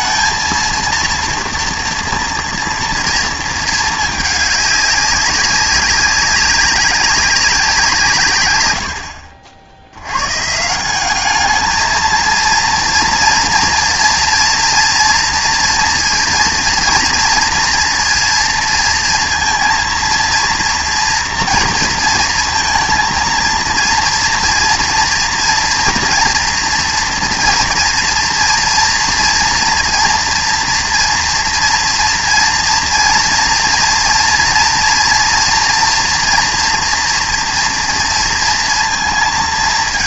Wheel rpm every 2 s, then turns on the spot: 230, 230, 210, 190, 90, 160, 230, 230, 240, 230, 230, 230, 230, 230, 230, 230, 230, 230, 230, 230.
none